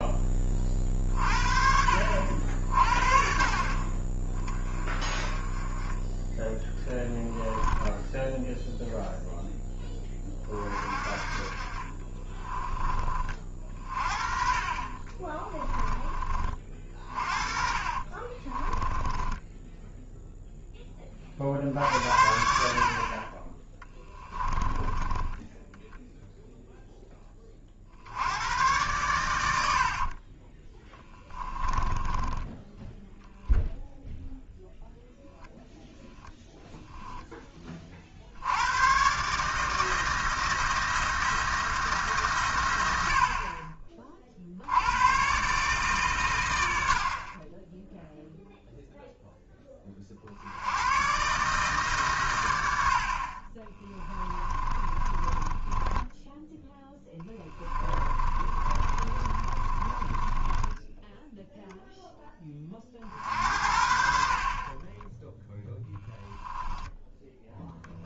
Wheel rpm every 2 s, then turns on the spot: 40, 60, 20, 10, 0, 40, 20, 40, 40, 20, 10, 60, 20, 0, 110, 20, 10, 0, 0, 100, 160, 110, 80, 80, 0, 100, 80, 30, 10, 40, 10, 30, 30, 0.
18-20 24-26 30-32 54-62 64-66